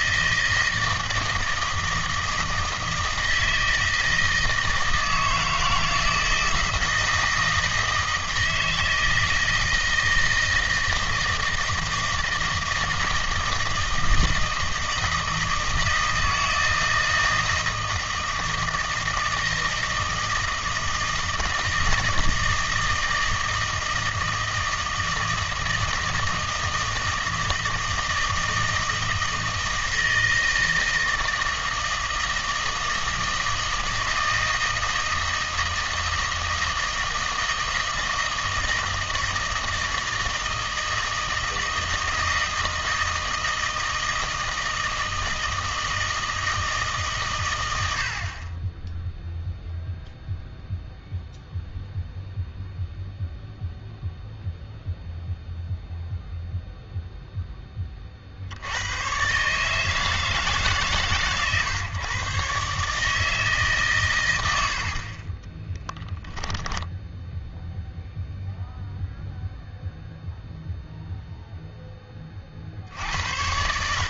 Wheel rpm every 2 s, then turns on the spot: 160, 160, 160, 160, 160, 160, 160, 160, 160, 160, 160, 160, 160, 160, 160, 160, 160, 160, 160, 160, 160, 160, 160, 160, 20, 0, 0, 0, 0, 90, 150, 140, 70, 0, 0, 0, 60.
64-66